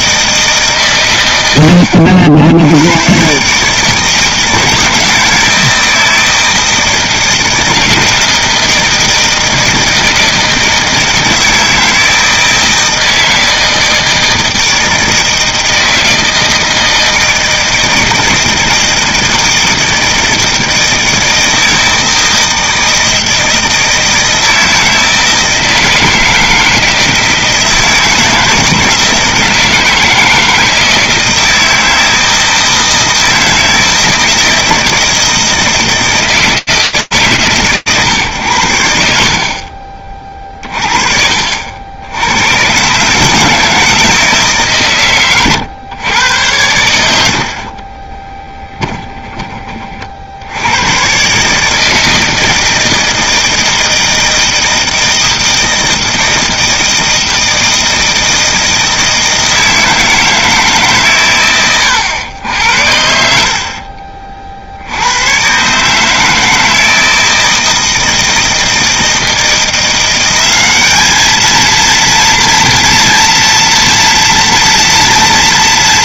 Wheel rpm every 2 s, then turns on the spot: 150, 90, 160, 160, 160, 160, 160, 160, 160, 160, 160, 160, 160, 160, 160, 160, 160, 160, 160, 110, 40, 110, 140, 100, 10, 100, 160, 160, 160, 160, 150, 80, 70, 160, 160, 200, 230, 240.
none